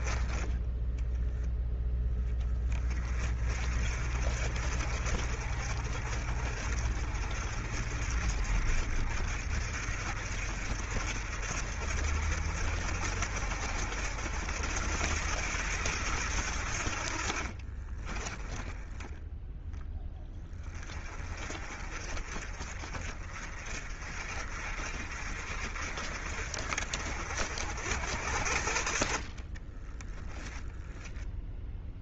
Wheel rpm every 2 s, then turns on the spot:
10, 20, 50, 50, 60, 60, 60, 80, 60, 20, 30, 40, 50, 50, 50, 0.
0-2